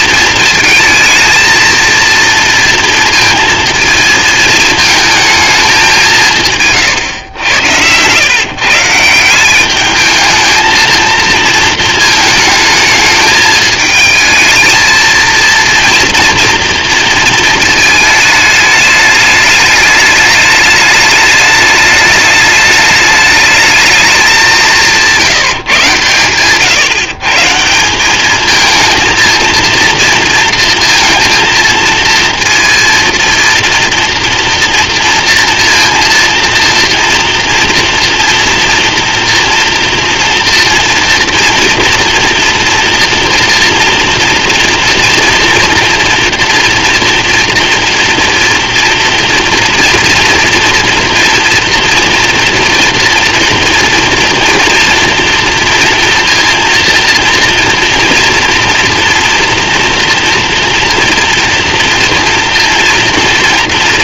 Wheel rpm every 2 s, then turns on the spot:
220, 230, 220, 110, 170, 220, 220, 230, 230, 210, 210, 210, 180, 150, 230, 230, 230, 230, 230, 230, 230, 230, 230, 240, 240, 230, 240, 230, 230, 230, 240, 230.
none